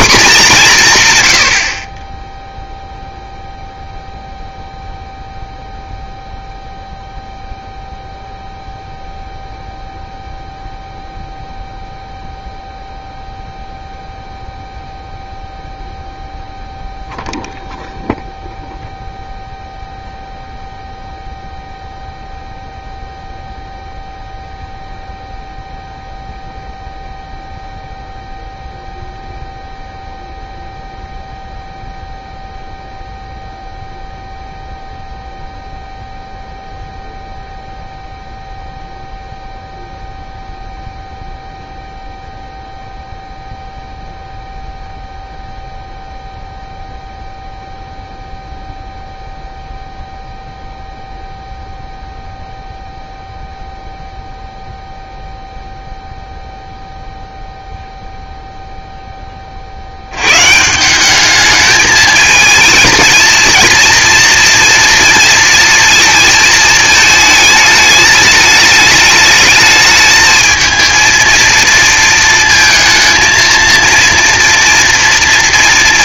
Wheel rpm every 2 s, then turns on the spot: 190, 0, 0, 0, 0, 0, 0, 0, 0, 0, 0, 0, 0, 0, 0, 0, 0, 0, 0, 0, 0, 0, 0, 0, 0, 0, 0, 0, 0, 0, 150, 220, 230, 220, 210, 220, 220, 230.
none